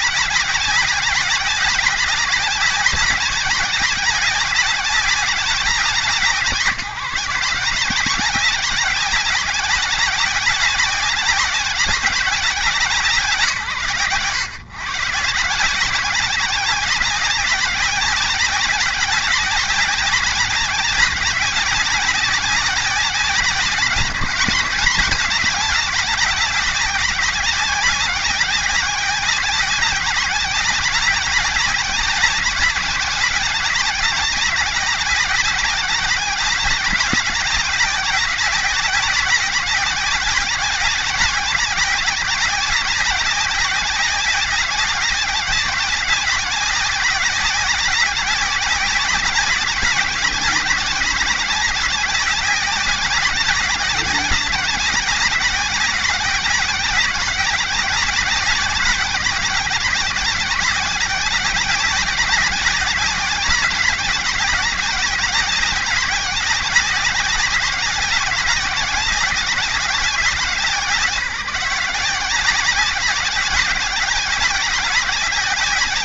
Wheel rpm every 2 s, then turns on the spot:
190, 190, 190, 160, 190, 190, 180, 130, 190, 190, 190, 190, 200, 190, 190, 190, 190, 190, 190, 190, 190, 180, 190, 190, 190, 190, 180, 180, 190, 180, 190, 200, 190, 190, 180, 170, 180, 190.
none